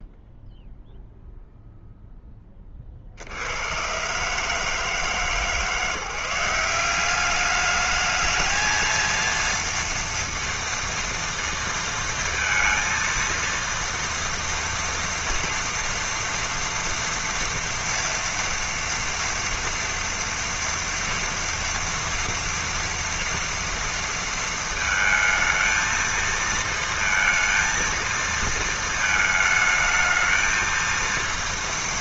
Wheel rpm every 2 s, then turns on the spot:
0, 60, 150, 200, 230, 230, 230, 230, 230, 230, 230, 230, 220, 230, 220, 230.
none